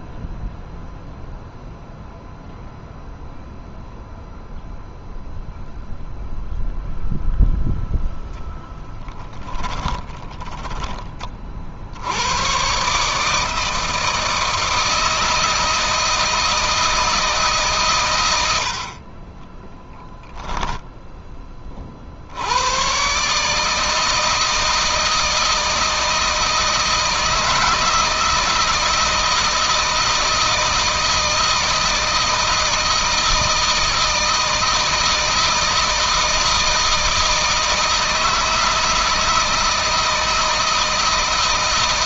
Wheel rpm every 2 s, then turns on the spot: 0, 0, 0, 0, 10, 20, 140, 160, 160, 60, 10, 120, 160, 160, 160, 160, 160, 160, 160, 160, 160.
8-10 20-22